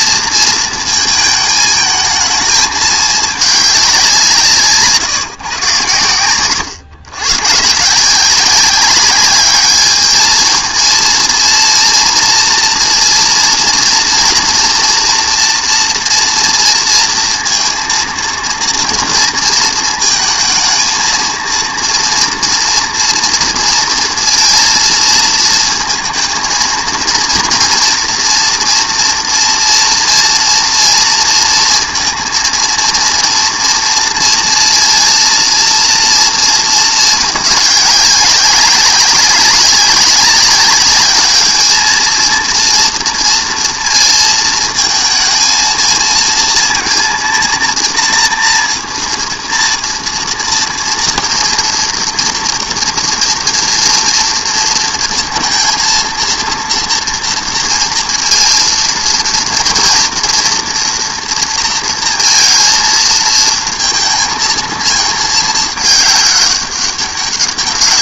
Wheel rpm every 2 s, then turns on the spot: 230, 220, 170, 110, 180, 220, 230, 240, 230, 230, 220, 230, 230, 230, 230, 230, 230, 230, 220, 190, 190, 230, 230, 230, 230, 230, 240, 230, 230, 230, 230, 230, 220, 200.
none